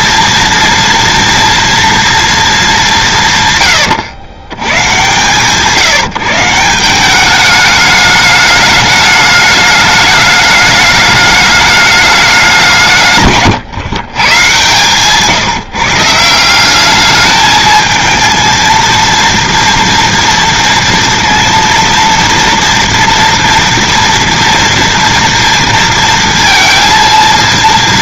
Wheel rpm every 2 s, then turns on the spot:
230, 210, 110, 170, 210, 210, 180, 120, 180, 230, 230, 240, 230, 230.
14-16